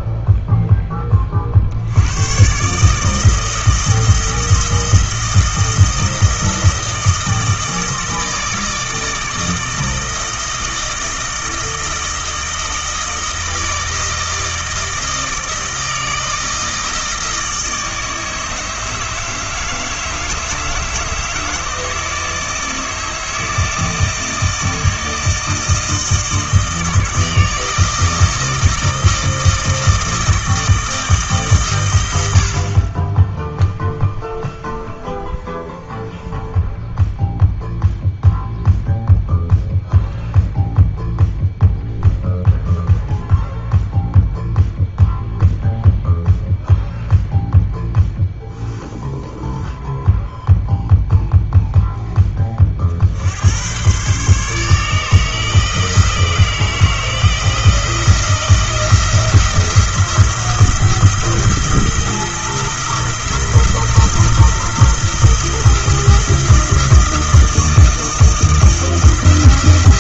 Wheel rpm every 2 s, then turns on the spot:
0, 140, 160, 160, 160, 160, 160, 160, 160, 150, 150, 160, 160, 160, 160, 160, 70, 0, 0, 0, 0, 0, 0, 0, 0, 0, 20, 140, 160, 170, 170, 170, 170, 170, 170.
none